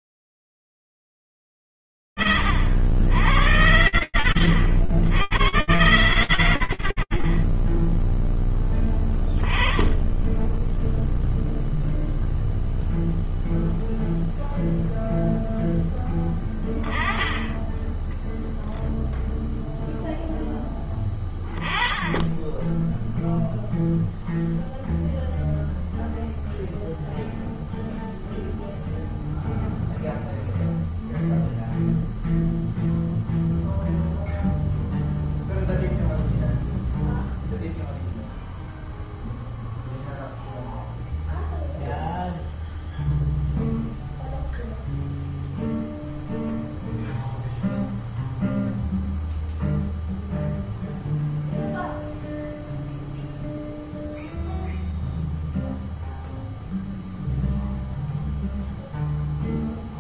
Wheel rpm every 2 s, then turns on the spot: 0, 40, 60, 80, 0, 10, 0, 0, 10, 0, 10, 10, 0, 0, 0, 0, 0, 0, 0, 0, 0, 0, 0, 0, 0, 0, 0, 0, 0, 0.
none